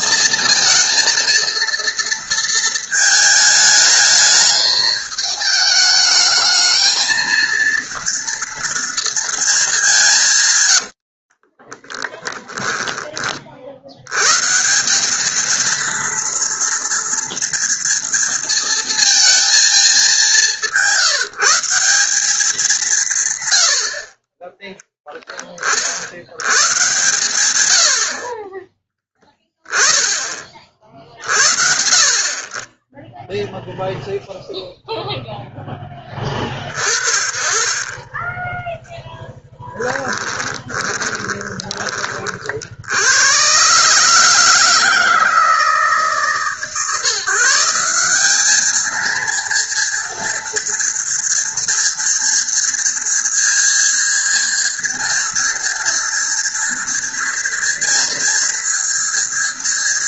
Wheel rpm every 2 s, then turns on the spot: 230, 220, 210, 230, 220, 30, 40, 220, 230, 230, 170, 110, 10, 110, 10, 60, 0, 0, 40, 10, 20, 90, 160, 150, 230, 230, 230, 230, 230, 230.
10-12 40-42